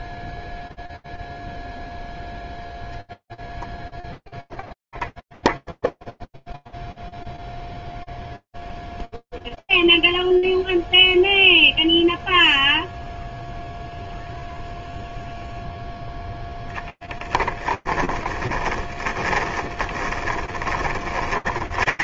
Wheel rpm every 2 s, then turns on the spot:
0, 0, 0, 0, 0, 0, 0, 0, 10, 20, 30.
16-22